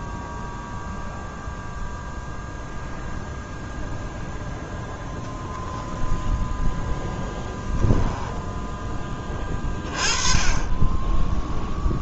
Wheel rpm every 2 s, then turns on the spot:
0, 0, 0, 0, 10, 20.
none